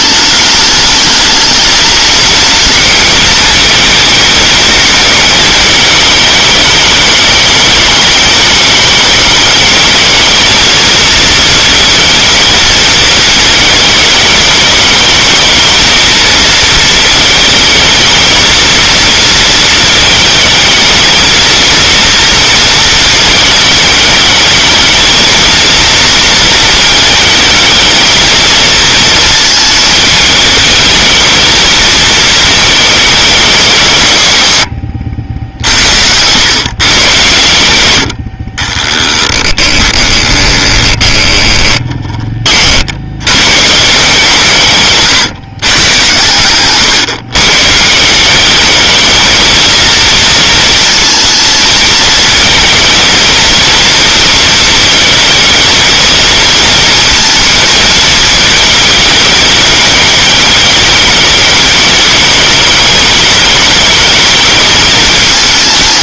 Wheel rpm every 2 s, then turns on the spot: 210, 220, 220, 210, 210, 220, 220, 220, 230, 230, 220, 230, 220, 230, 220, 220, 220, 120, 110, 40, 20, 40, 150, 130, 200, 230, 220, 220, 220, 220, 210, 210, 220.
34-36 38-42